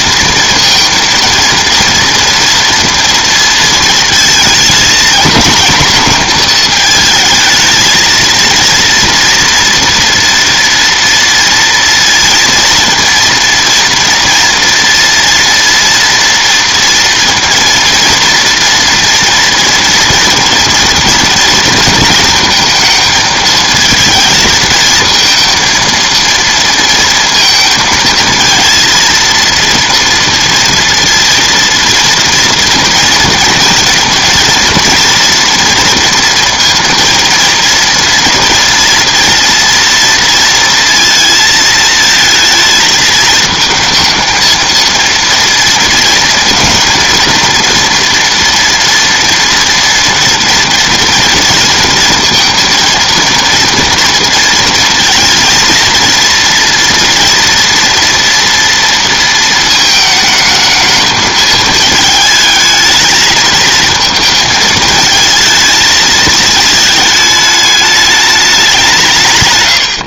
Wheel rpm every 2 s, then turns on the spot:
230, 230, 230, 230, 230, 230, 230, 230, 230, 230, 230, 230, 220, 230, 230, 230, 230, 230, 230, 230, 230, 220, 230, 230, 240, 230, 230, 230, 230, 230, 220, 220, 220, 220, 200.
none